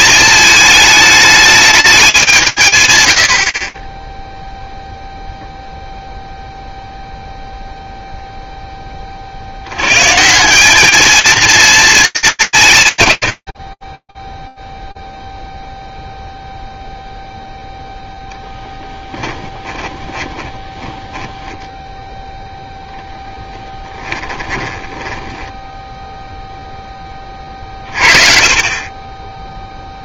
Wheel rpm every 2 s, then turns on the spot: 220, 160, 0, 0, 10, 190, 180, 0, 0, 10, 10, 10, 10, 20, 20.
18-22 24-26